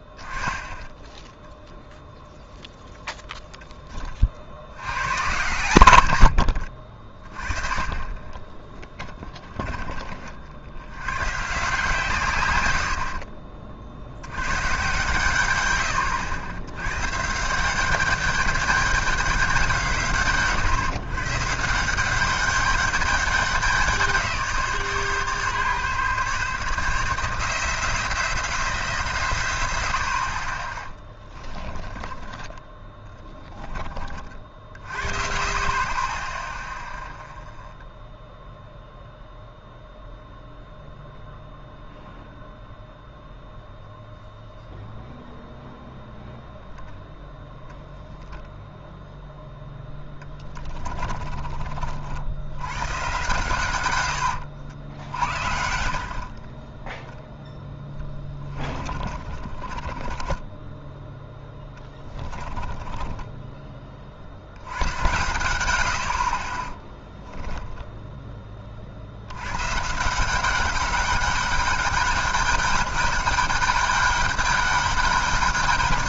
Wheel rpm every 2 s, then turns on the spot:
20, 0, 90, 50, 20, 90, 70, 130, 100, 200, 130, 200, 160, 150, 160, 20, 10, 50, 0, 0, 0, 0, 0, 0, 0, 30, 120, 80, 10, 20, 10, 10, 100, 20, 40, 190, 200, 200.
8-10 50-52 58-64 66-68